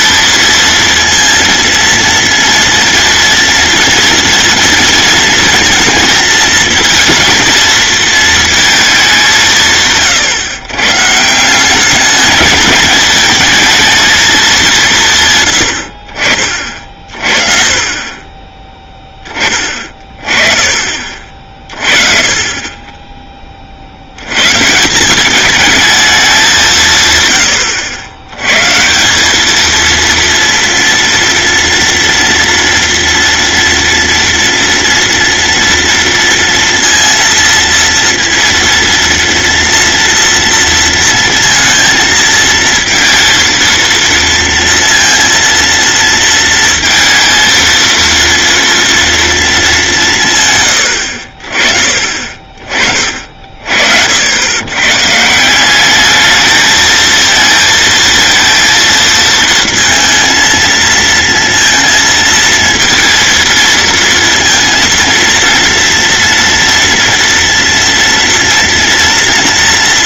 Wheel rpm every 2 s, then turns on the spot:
230, 230, 230, 220, 220, 120, 210, 190, 40, 10, 30, 30, 140, 170, 140, 230, 230, 230, 230, 230, 230, 230, 230, 230, 230, 100, 30, 120, 220, 230, 220, 230, 230, 230, 240.
none